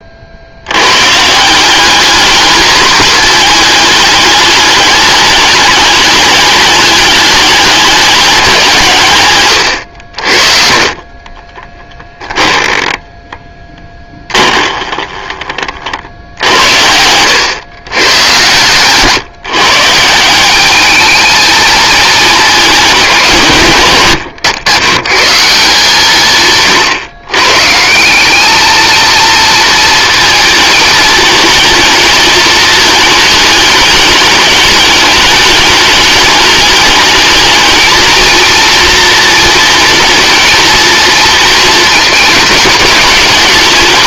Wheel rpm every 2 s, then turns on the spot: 80, 220, 210, 210, 160, 40, 10, 20, 80, 120, 200, 210, 120, 130, 220, 220, 210, 210, 210, 230, 230, 220.
14-18